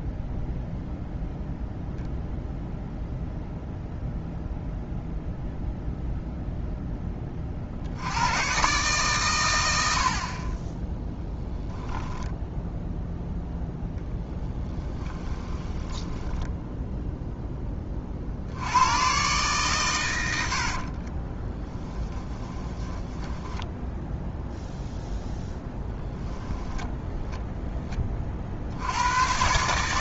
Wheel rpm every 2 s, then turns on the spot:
0, 0, 0, 10, 140, 20, 0, 10, 0, 100, 50, 10, 0, 0, 80.
14-16 20-24